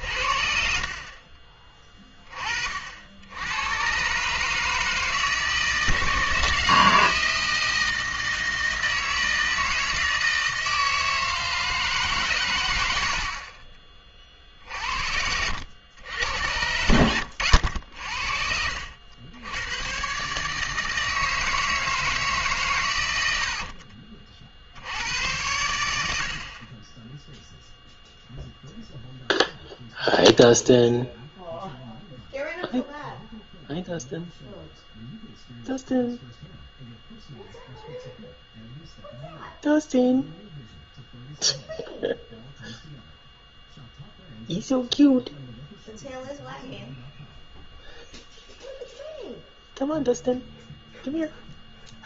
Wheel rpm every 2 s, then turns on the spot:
50, 50, 150, 160, 160, 160, 80, 60, 80, 60, 150, 140, 40, 60, 0, 0, 0, 0, 0, 0, 0, 0, 0, 0, 0, 0.
0-2 12-14